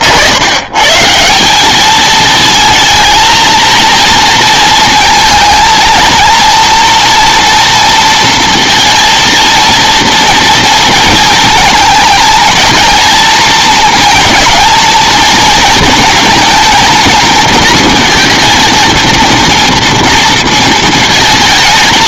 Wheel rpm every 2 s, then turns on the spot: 110, 220, 230, 230, 230, 230, 220, 230, 220, 230, 230.
none